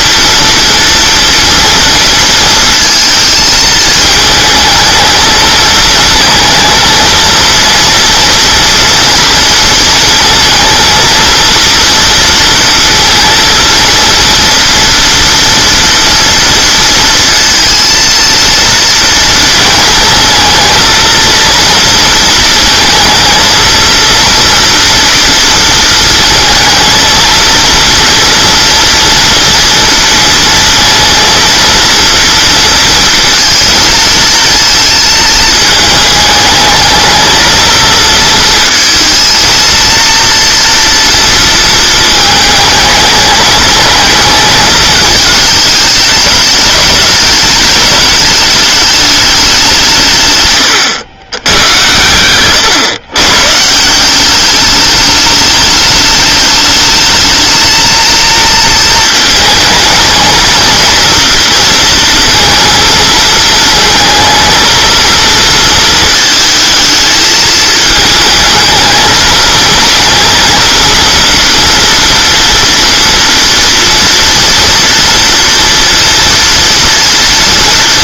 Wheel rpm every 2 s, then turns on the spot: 240, 230, 220, 230, 230, 230, 230, 240, 230, 230, 220, 230, 230, 230, 240, 230, 230, 230, 220, 230, 230, 210, 210, 210, 210, 120, 120, 210, 210, 230, 230, 230, 230, 220, 220, 230, 230, 230, 230.
50-52